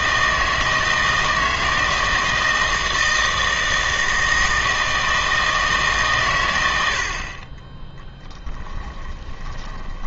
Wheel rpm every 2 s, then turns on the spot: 160, 160, 160, 100, 10.
8-10